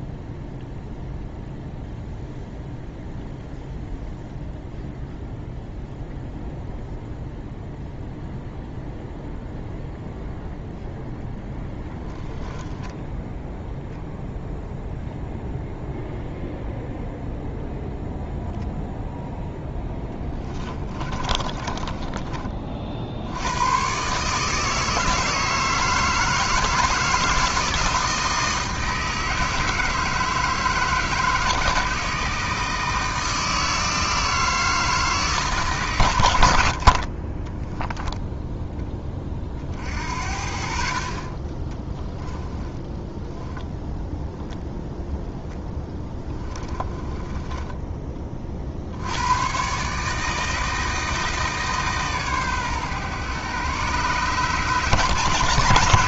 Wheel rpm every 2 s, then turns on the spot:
0, 0, 0, 0, 0, 0, 0, 0, 0, 0, 30, 50, 160, 160, 160, 160, 160, 160, 70, 10, 50, 10, 0, 20, 60, 160, 130, 140.
20-22 36-38 42-44 46-48